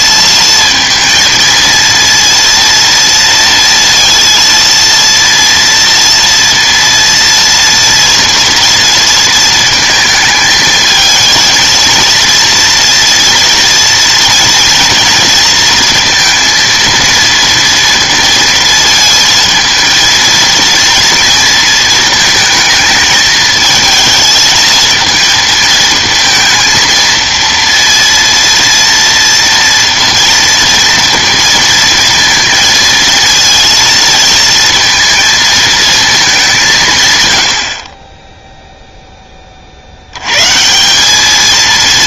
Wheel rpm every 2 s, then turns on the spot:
230, 230, 230, 230, 230, 220, 230, 230, 230, 230, 230, 220, 220, 230, 230, 230, 230, 220, 180, 0, 150.
none